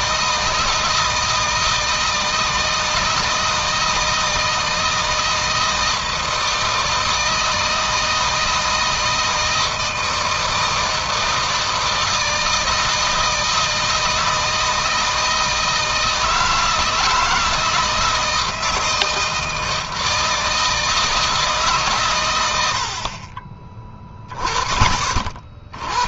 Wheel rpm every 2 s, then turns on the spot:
160, 160, 160, 160, 160, 160, 160, 160, 160, 160, 160, 80, 20.
none